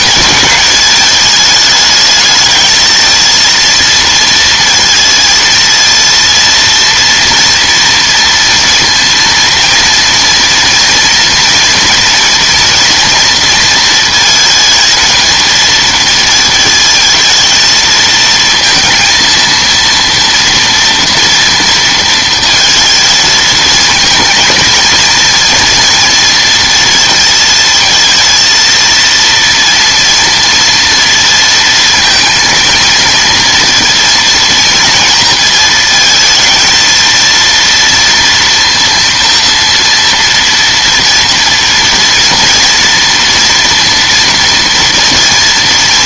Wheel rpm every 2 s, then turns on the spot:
220, 220, 230, 230, 230, 230, 230, 230, 220, 230, 230, 230, 230, 220, 230, 230, 230, 230, 230, 230, 230, 230, 240.
none